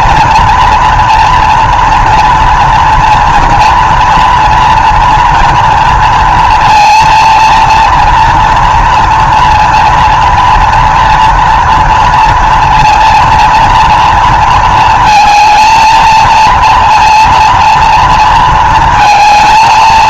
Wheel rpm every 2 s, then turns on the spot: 230, 230, 240, 230, 230, 230, 230, 220, 230, 230.
none